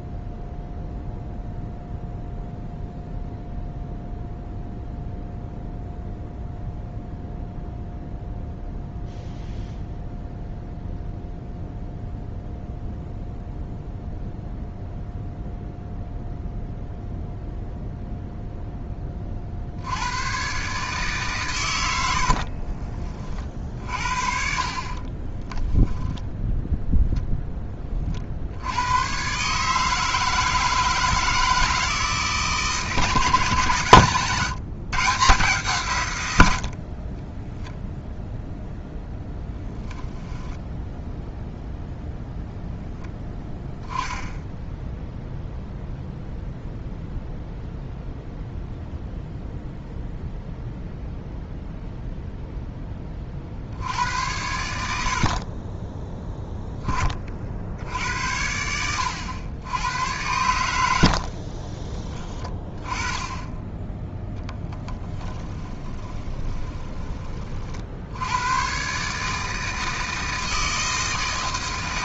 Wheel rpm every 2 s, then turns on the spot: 0, 0, 0, 0, 0, 0, 0, 0, 0, 10, 140, 30, 50, 0, 90, 160, 150, 130, 60, 0, 0, 0, 0, 0, 0, 0, 10, 80, 20, 90, 70, 10, 10, 20, 130, 160.
22-26 60-62 64-66